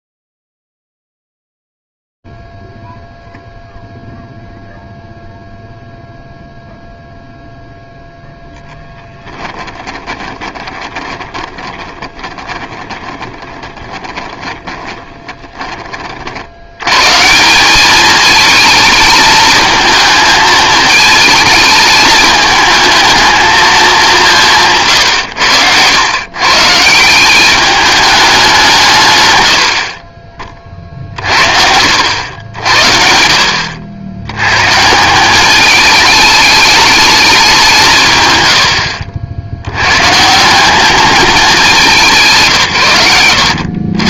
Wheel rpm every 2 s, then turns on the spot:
0, 0, 0, 0, 10, 20, 20, 20, 100, 220, 220, 220, 150, 150, 200, 30, 70, 150, 210, 100, 190, 140.
8-16